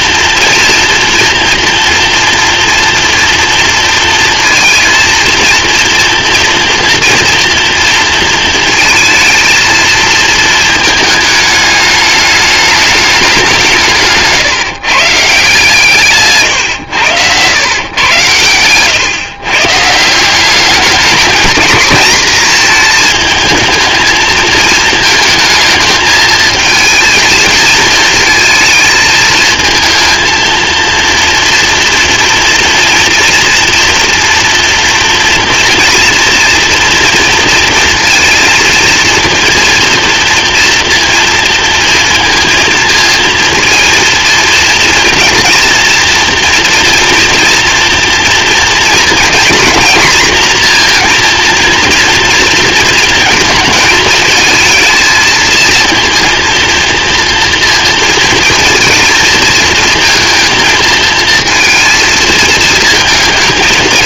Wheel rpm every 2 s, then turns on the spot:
230, 230, 230, 230, 230, 220, 210, 150, 130, 110, 200, 220, 230, 220, 220, 230, 230, 230, 230, 230, 230, 230, 230, 230, 230, 240, 230, 220, 230, 230, 230, 220.
none